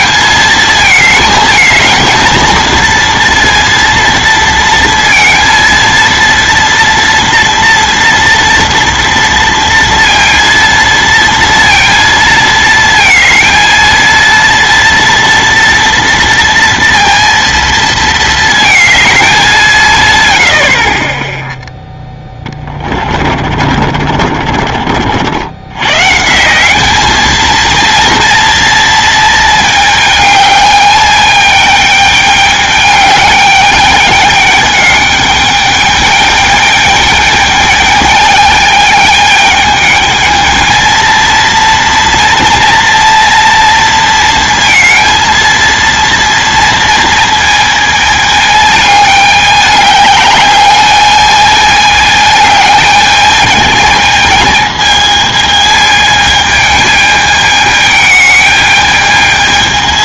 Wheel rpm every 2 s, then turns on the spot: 220, 230, 230, 230, 230, 230, 220, 230, 230, 220, 80, 20, 50, 190, 230, 210, 210, 210, 210, 210, 220, 230, 230, 230, 210, 210, 210, 220, 220, 210.
22-26